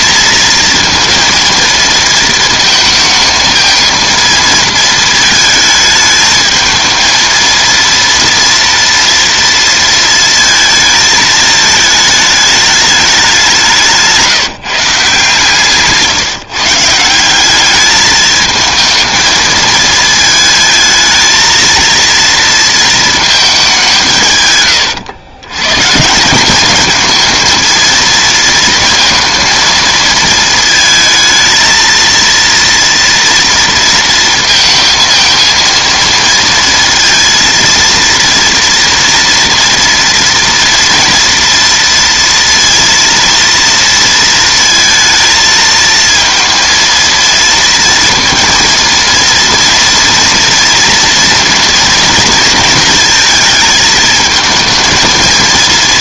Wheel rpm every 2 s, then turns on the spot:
230, 220, 220, 220, 230, 230, 210, 170, 150, 220, 220, 230, 120, 190, 230, 230, 230, 230, 230, 230, 240, 230, 230, 230, 230, 230, 230, 220.
none